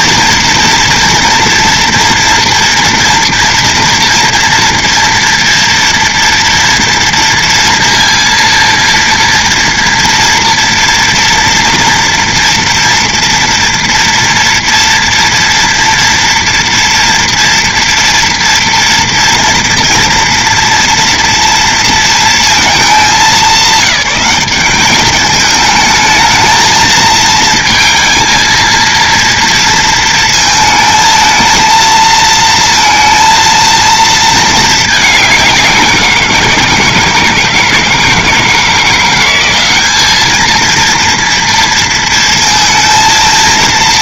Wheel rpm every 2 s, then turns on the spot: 230, 230, 230, 230, 230, 240, 240, 230, 230, 230, 230, 220, 200, 220, 230, 220, 230, 210, 170, 170, 230, 220.
none